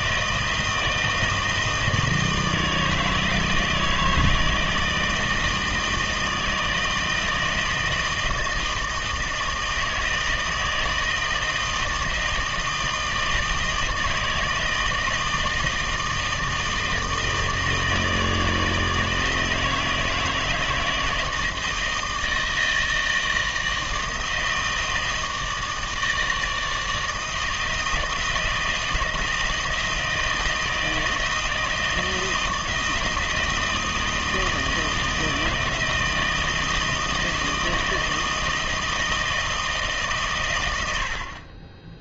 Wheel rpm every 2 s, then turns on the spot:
160, 160, 160, 160, 160, 160, 160, 160, 160, 160, 160, 160, 160, 160, 160, 160, 170, 160, 160, 160, 90.
none